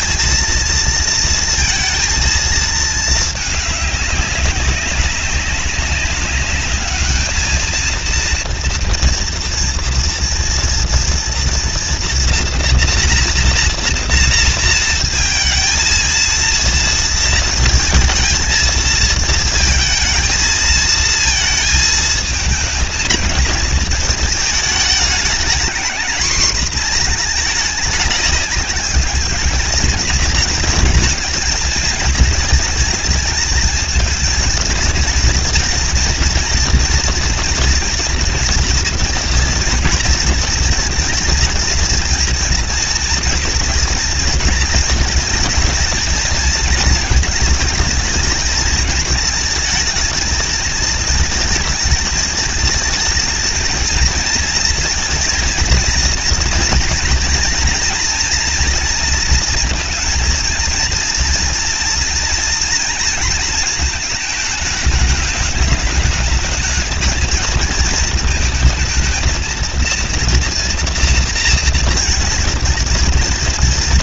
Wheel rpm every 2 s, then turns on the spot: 230, 220, 200, 200, 230, 230, 240, 230, 230, 230, 220, 230, 220, 230, 200, 230, 220, 220, 230, 230, 230, 230, 220, 230, 220, 220, 220, 230, 230, 240, 230, 230, 210, 220, 220, 230, 230.
none